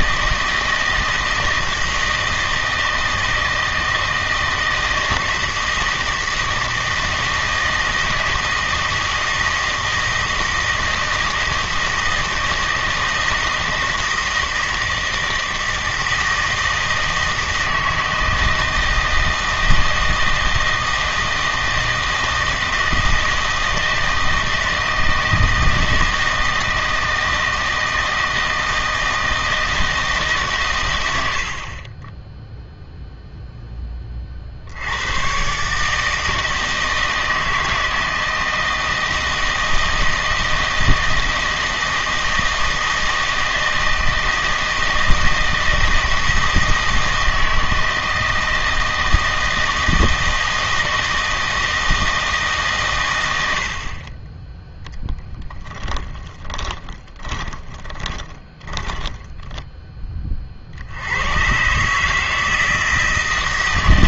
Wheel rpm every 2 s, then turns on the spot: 160, 160, 160, 160, 160, 160, 160, 160, 160, 160, 160, 160, 160, 160, 160, 120, 0, 80, 160, 160, 160, 160, 160, 160, 160, 160, 130, 0, 20, 20, 70, 160.
56-60